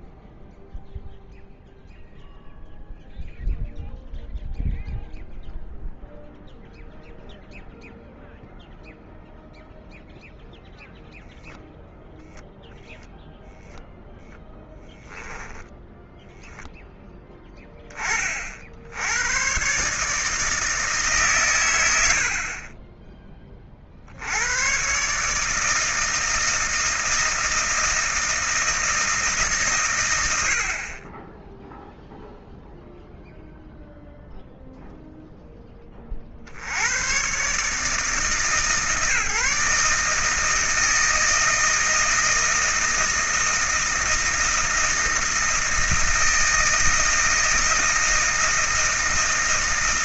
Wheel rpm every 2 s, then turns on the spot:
0, 0, 0, 0, 0, 0, 0, 10, 10, 60, 160, 20, 120, 160, 160, 60, 0, 0, 90, 140, 160, 160, 160, 160, 160.
none